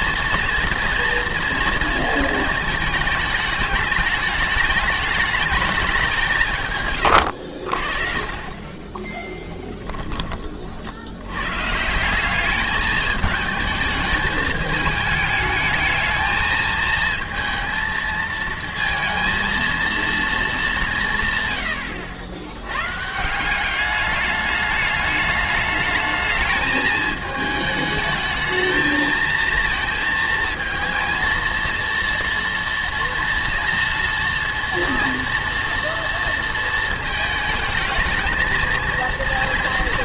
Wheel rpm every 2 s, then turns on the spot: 230, 220, 210, 150, 30, 40, 200, 210, 220, 230, 210, 110, 210, 210, 220, 220, 230, 230, 230, 230.
8-10